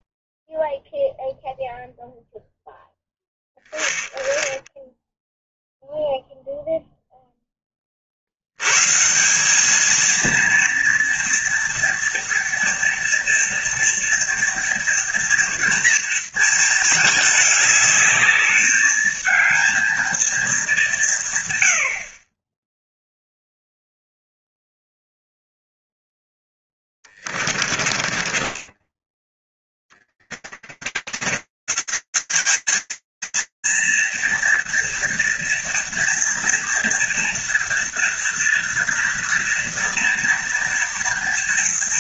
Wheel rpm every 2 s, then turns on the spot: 0, 0, 0, 0, 70, 230, 230, 240, 230, 210, 220, 40, 0, 0, 20, 30, 150, 230, 230, 230, 230.
28-32